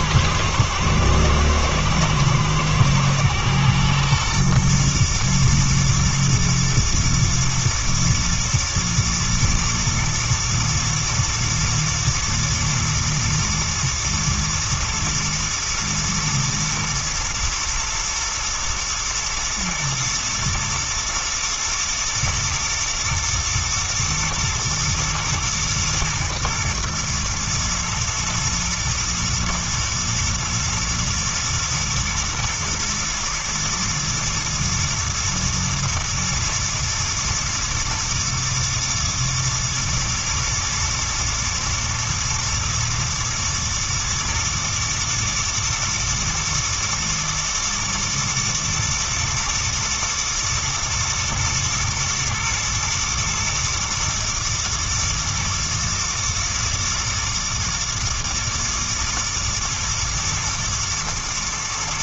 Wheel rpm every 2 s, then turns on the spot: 110, 110, 120, 120, 110, 110, 120, 110, 110, 110, 110, 110, 110, 110, 120, 120, 110, 120, 120, 120, 120, 110, 110, 120, 120, 110, 120, 120, 120, 110, 110.
none